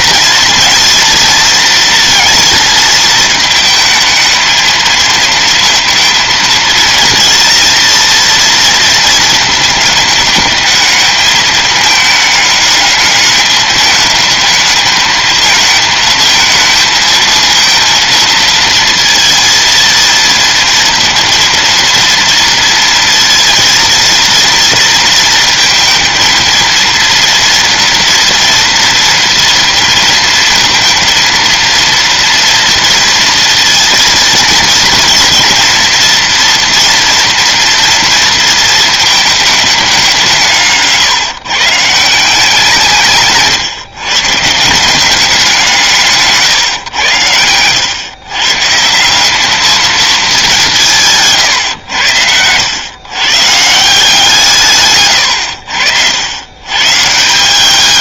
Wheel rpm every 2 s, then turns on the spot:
230, 230, 220, 230, 230, 210, 210, 210, 220, 230, 230, 230, 230, 230, 230, 230, 230, 230, 240, 230, 150, 180, 160, 130, 140, 200, 90, 140, 120.
none